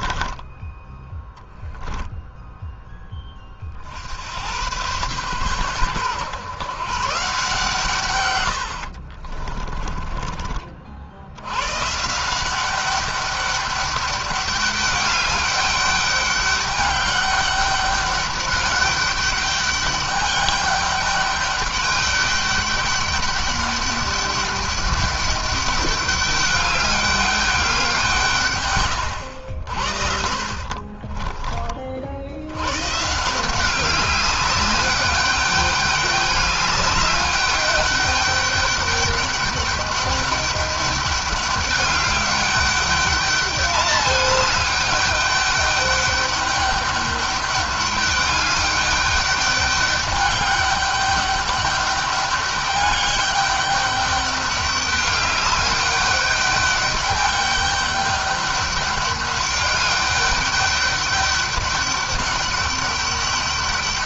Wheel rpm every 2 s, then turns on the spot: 10, 10, 110, 140, 70, 60, 200, 200, 200, 200, 210, 200, 200, 200, 110, 50, 120, 200, 200, 200, 200, 200, 210, 200, 200, 200, 200, 200, 200, 200, 200, 200.
8-10 30-32